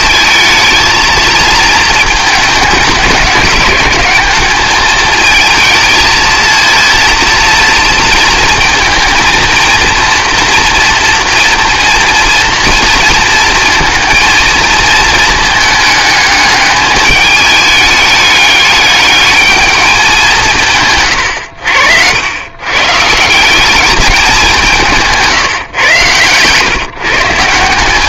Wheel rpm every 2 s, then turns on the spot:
220, 210, 220, 230, 230, 230, 230, 230, 210, 210, 150, 140, 180, 130.
none